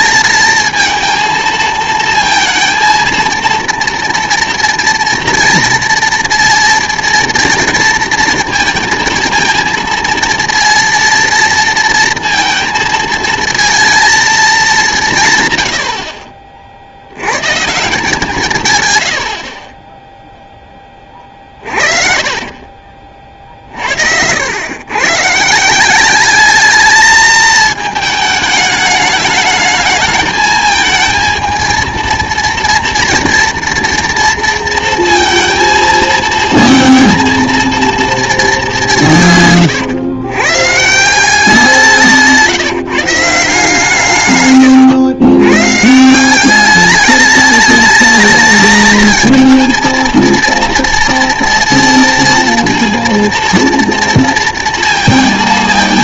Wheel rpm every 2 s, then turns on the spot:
230, 230, 230, 230, 220, 230, 230, 190, 60, 120, 10, 40, 110, 210, 210, 220, 230, 230, 230, 200, 140, 160, 120, 200, 220, 230, 230, 230.
22-24 44-46